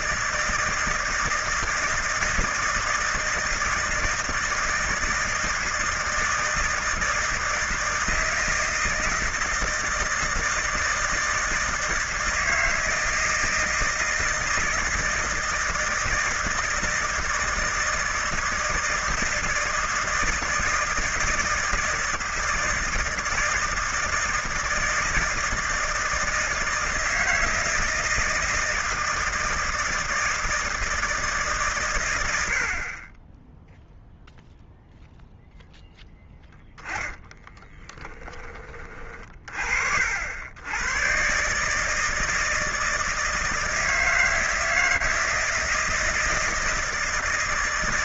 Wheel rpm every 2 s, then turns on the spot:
160, 160, 160, 160, 160, 160, 160, 160, 160, 160, 160, 160, 160, 160, 160, 160, 30, 0, 10, 30, 120, 160, 160, 160.
none